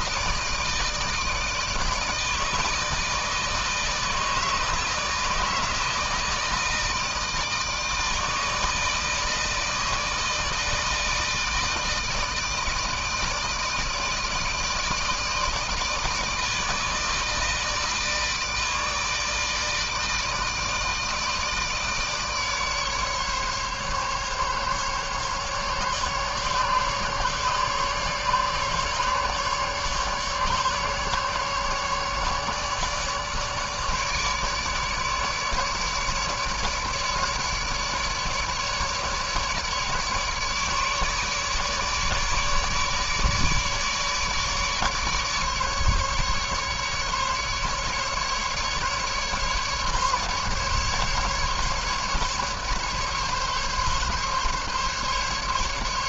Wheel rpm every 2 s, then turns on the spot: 160, 160, 160, 160, 160, 160, 160, 160, 160, 150, 160, 150, 140, 140, 140, 150, 150, 150, 150, 150, 150, 150, 150, 140, 150, 150, 150, 140.
none